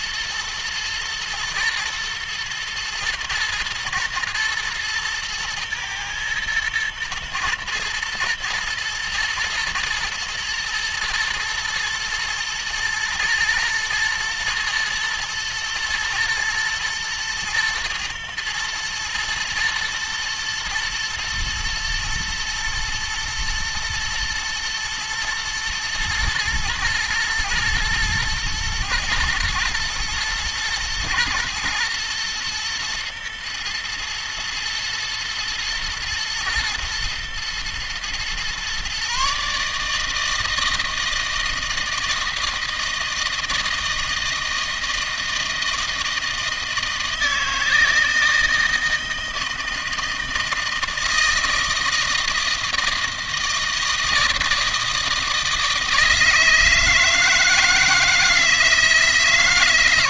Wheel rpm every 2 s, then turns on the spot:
120, 110, 110, 110, 120, 110, 120, 120, 120, 110, 110, 120, 110, 120, 120, 120, 120, 110, 110, 130, 160, 160, 160, 160, 160, 160, 160, 160, 160, 160.
none